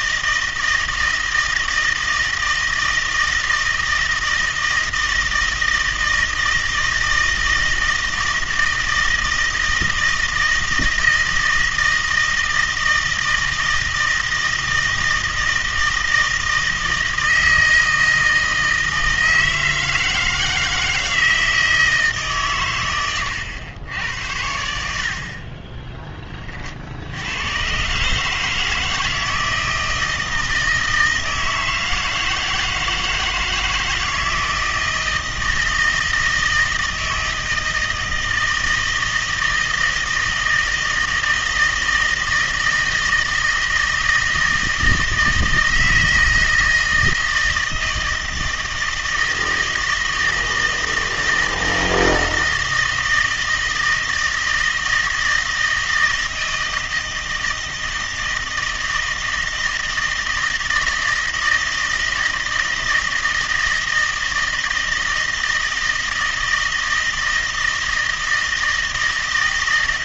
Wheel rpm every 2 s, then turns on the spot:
160, 160, 160, 160, 160, 160, 160, 160, 160, 160, 160, 110, 70, 50, 160, 160, 160, 160, 160, 160, 160, 160, 160, 160, 160, 160, 160, 160, 160, 160, 160, 160, 160, 160, 160.
none